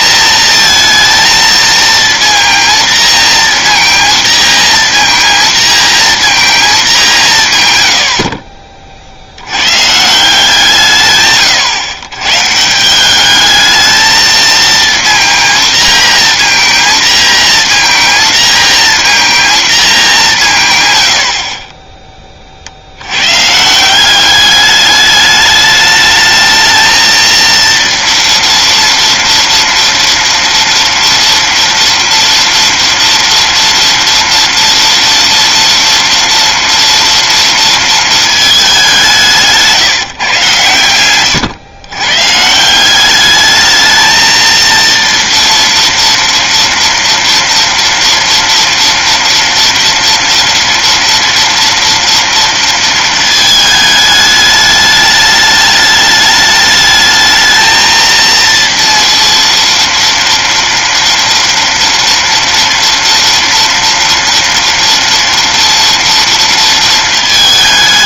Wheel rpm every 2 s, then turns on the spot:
230, 230, 230, 220, 40, 170, 140, 230, 230, 230, 150, 40, 200, 220, 230, 230, 240, 240, 230, 210, 130, 160, 230, 230, 230, 230, 230, 210, 210, 230, 240, 240, 240, 230.
none